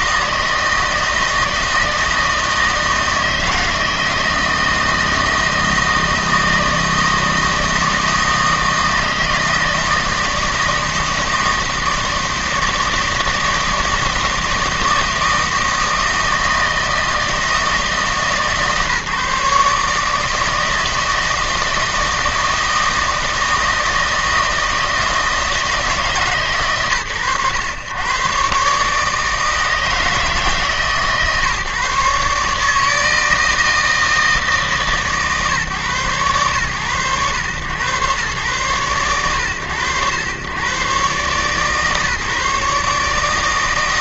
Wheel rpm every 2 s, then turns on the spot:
160, 160, 160, 160, 160, 160, 160, 160, 160, 150, 160, 160, 160, 120, 130, 140, 160, 150, 100, 110, 120, 140.
none